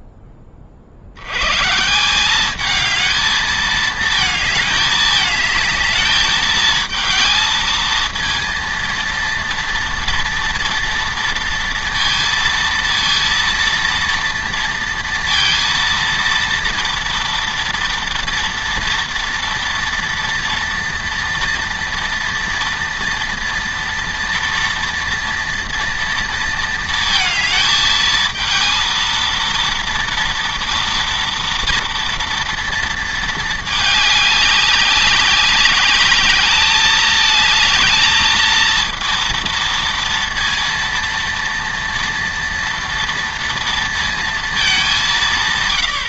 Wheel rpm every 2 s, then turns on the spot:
40, 210, 220, 220, 230, 230, 230, 230, 230, 230, 230, 230, 240, 230, 220, 230, 230, 200, 210, 230, 230, 230, 220.
none